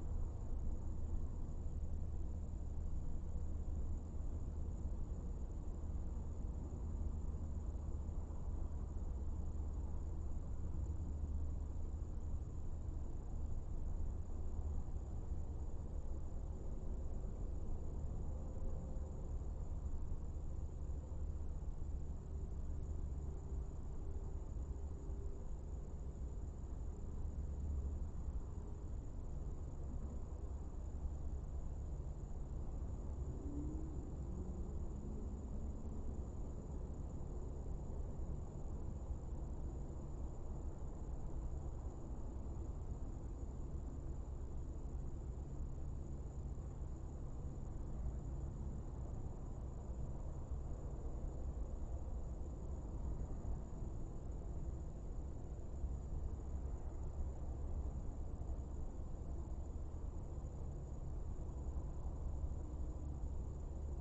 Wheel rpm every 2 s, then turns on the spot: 0, 0, 0, 0, 0, 0, 0, 0, 0, 0, 0, 0, 0, 0, 0, 0, 0, 0, 0, 0, 0, 0, 0, 0, 0, 0, 0, 0, 0, 0, 0, 0.
none